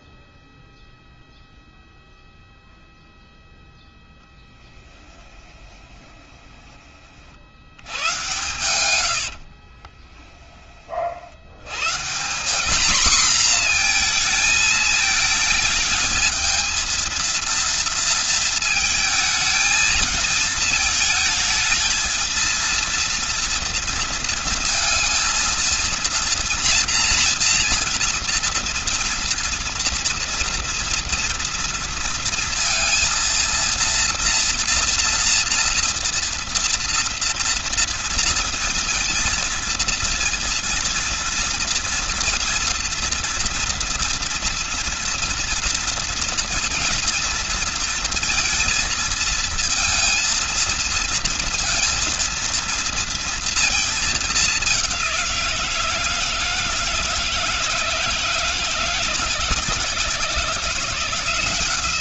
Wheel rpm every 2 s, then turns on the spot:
0, 0, 10, 20, 110, 30, 200, 220, 220, 230, 220, 230, 230, 230, 230, 230, 230, 230, 230, 230, 230, 230, 230, 230, 230, 230, 230, 200, 160, 160, 170.
4-6 8-10